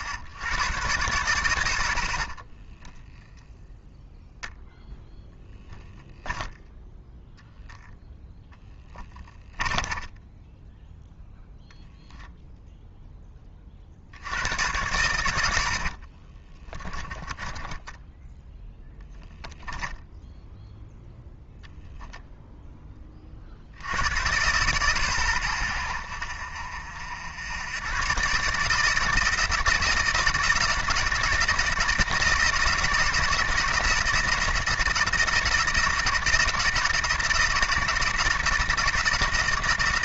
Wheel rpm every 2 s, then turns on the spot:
80, 10, 0, 0, 0, 10, 0, 100, 30, 10, 0, 10, 120, 70, 150, 160, 160, 160, 160, 160.
2-4 16-18